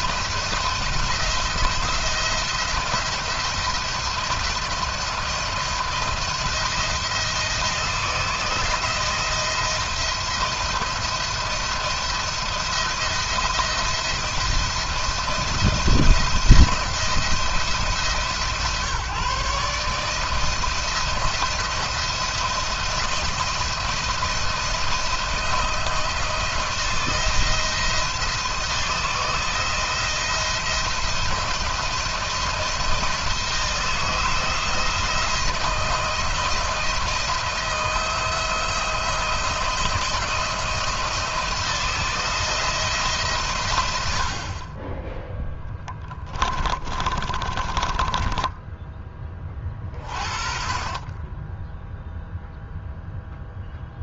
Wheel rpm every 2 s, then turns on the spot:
160, 170, 170, 170, 160, 170, 170, 170, 170, 140, 160, 170, 170, 170, 160, 170, 160, 160, 170, 170, 170, 160, 40, 30, 10, 30, 0.
46-50